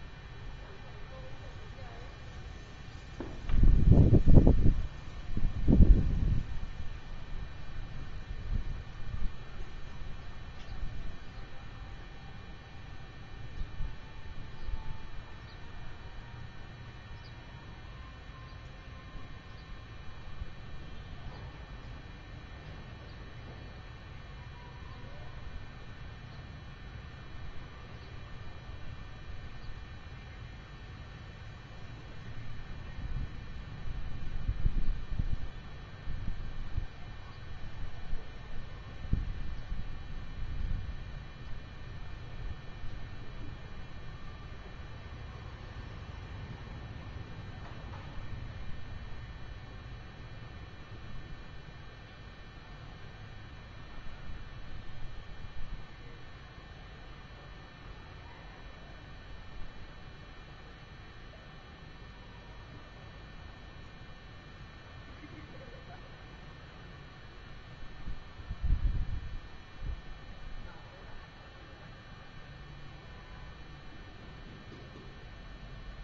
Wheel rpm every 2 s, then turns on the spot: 0, 0, 0, 0, 0, 0, 0, 0, 0, 0, 0, 0, 0, 0, 0, 0, 0, 0, 0, 0, 0, 0, 0, 0, 0, 0, 0, 0, 0, 0, 0, 0, 0, 0, 0, 0, 0, 0.
none